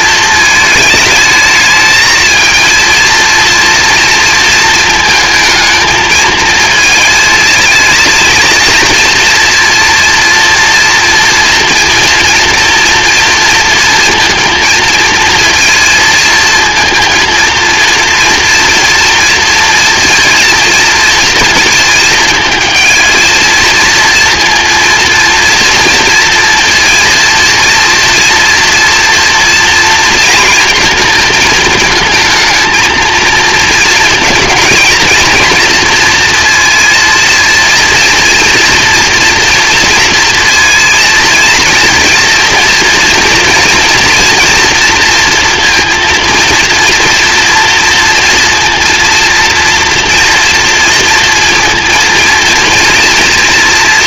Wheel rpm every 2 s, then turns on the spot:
220, 230, 220, 220, 230, 230, 230, 230, 230, 230, 230, 220, 240, 230, 230, 230, 220, 230, 230, 240, 230, 230, 230, 230, 230, 230, 230.
none